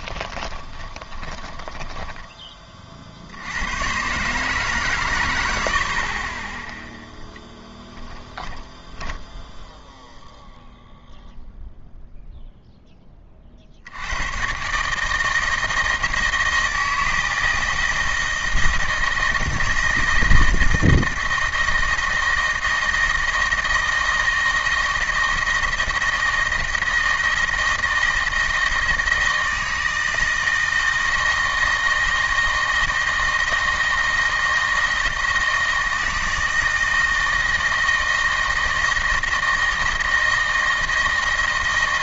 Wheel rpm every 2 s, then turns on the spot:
20, 30, 130, 10, 10, 0, 0, 130, 160, 160, 160, 160, 160, 160, 160, 160, 160, 160, 160, 160, 160.
0-2 8-10